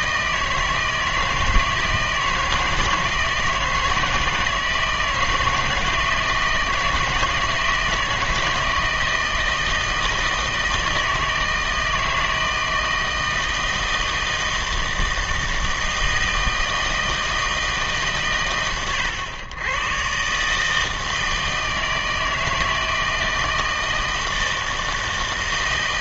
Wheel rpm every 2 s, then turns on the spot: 160, 160, 160, 160, 160, 160, 160, 160, 160, 110, 160, 160, 160.
none